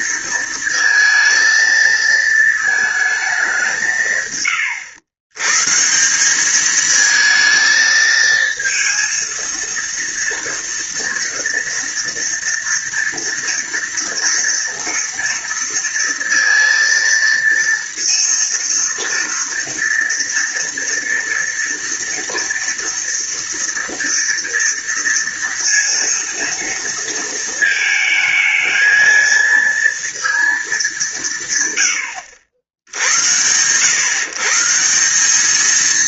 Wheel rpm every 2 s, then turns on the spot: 230, 220, 110, 210, 230, 230, 230, 230, 230, 230, 230, 230, 230, 230, 220, 210, 70, 150.
none